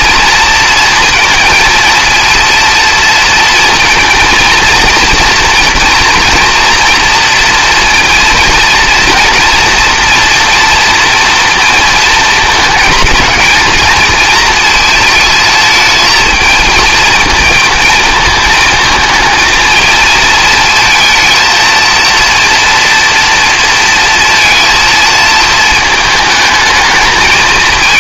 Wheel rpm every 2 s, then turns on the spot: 230, 230, 230, 230, 230, 230, 220, 220, 220, 220, 220, 230, 230, 220.
none